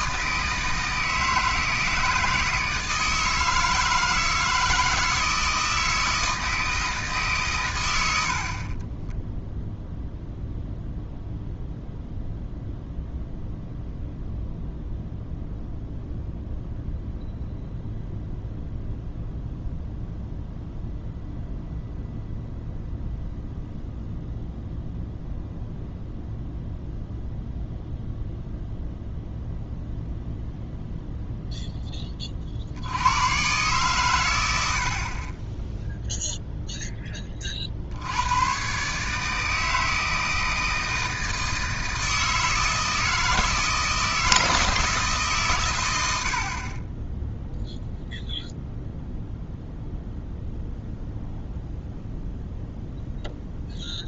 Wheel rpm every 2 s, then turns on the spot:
160, 160, 160, 160, 30, 0, 0, 0, 0, 0, 0, 0, 0, 0, 0, 0, 70, 50, 10, 140, 160, 160, 160, 20, 0, 0, 0.
46-48